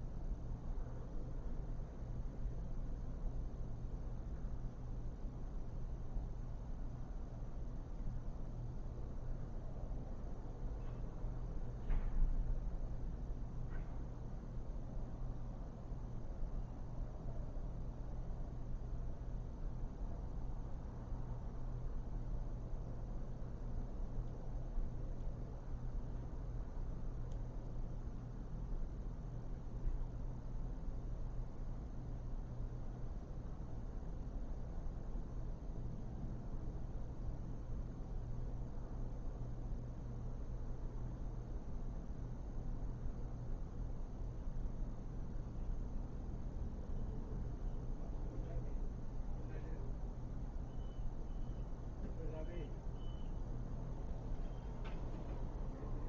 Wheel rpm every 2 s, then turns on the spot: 0, 0, 0, 0, 0, 0, 0, 0, 0, 0, 0, 0, 0, 0, 0, 0, 0, 0, 0, 0, 0, 0, 0, 0, 0, 0, 0, 0.
none